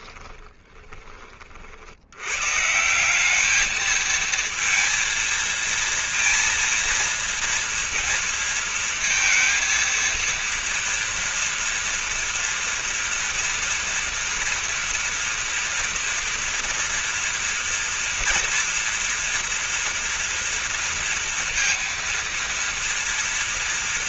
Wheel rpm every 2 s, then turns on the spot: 10, 150, 230, 230, 230, 230, 230, 230, 240, 230, 230, 230.
0-2